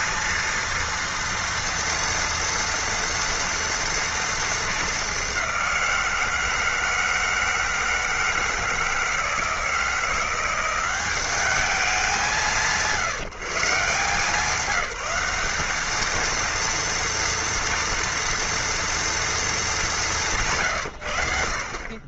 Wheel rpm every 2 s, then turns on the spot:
230, 230, 220, 160, 160, 180, 160, 180, 230, 230, 130.
none